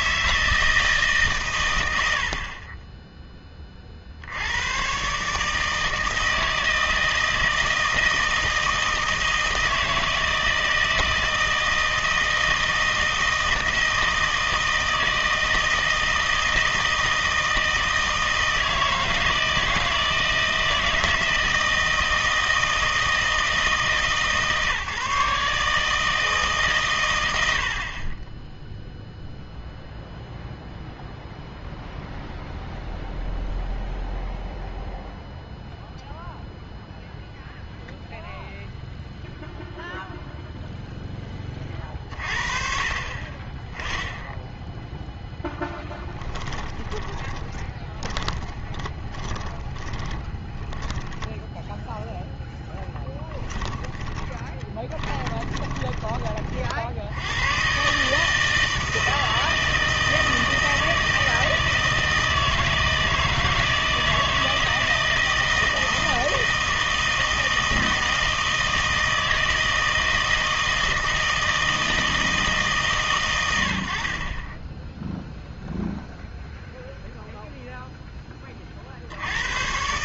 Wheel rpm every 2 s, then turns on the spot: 160, 20, 120, 160, 160, 160, 160, 160, 160, 160, 160, 160, 150, 130, 0, 0, 0, 0, 0, 0, 0, 40, 10, 20, 20, 10, 10, 10, 50, 160, 160, 160, 160, 160, 160, 160, 140, 10, 0, 50.
46-56